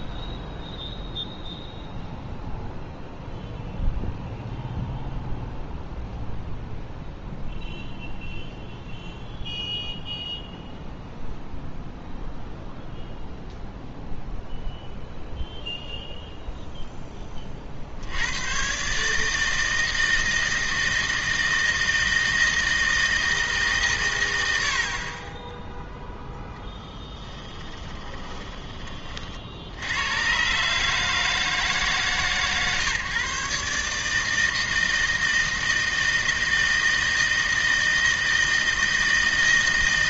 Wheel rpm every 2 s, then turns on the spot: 0, 0, 0, 0, 0, 0, 0, 0, 0, 130, 160, 160, 80, 0, 20, 140, 140, 160, 160, 160.
none